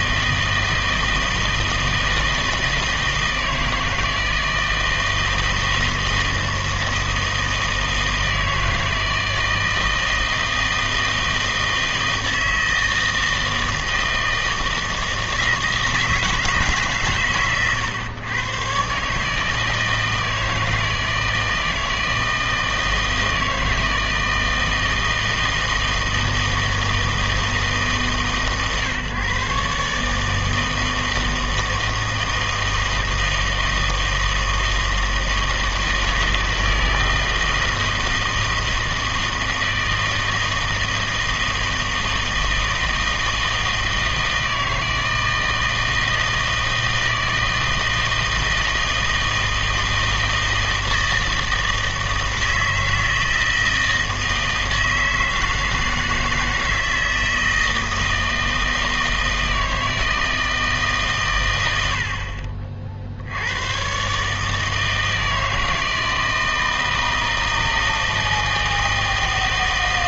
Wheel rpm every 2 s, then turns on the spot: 160, 160, 160, 160, 160, 160, 160, 160, 150, 120, 160, 160, 160, 160, 140, 160, 160, 160, 160, 160, 160, 160, 160, 160, 160, 160, 160, 160, 160, 160, 160, 40, 160, 160, 160.
none